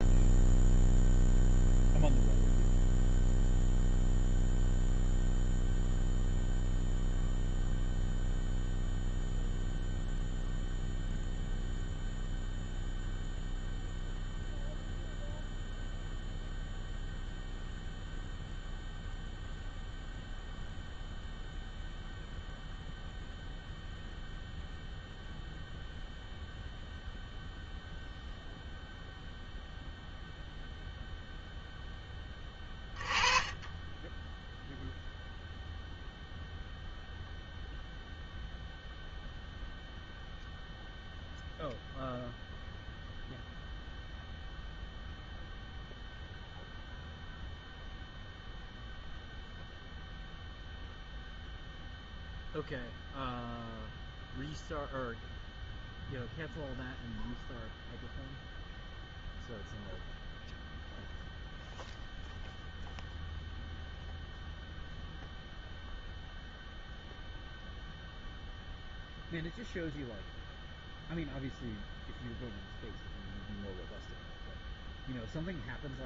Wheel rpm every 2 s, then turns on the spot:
0, 0, 0, 0, 0, 0, 0, 0, 0, 0, 0, 0, 0, 0, 0, 0, 20, 0, 0, 0, 0, 0, 0, 0, 0, 0, 0, 0, 0, 0, 0, 0, 0, 0, 0, 0, 0, 0.
none